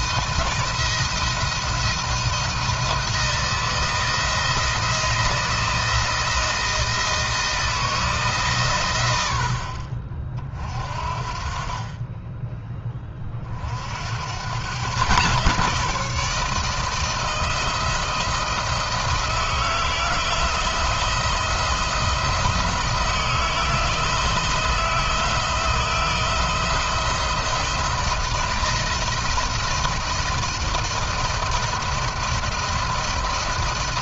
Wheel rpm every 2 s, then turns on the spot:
170, 170, 170, 160, 110, 50, 30, 130, 160, 160, 160, 170, 160, 160, 160, 160, 160.
none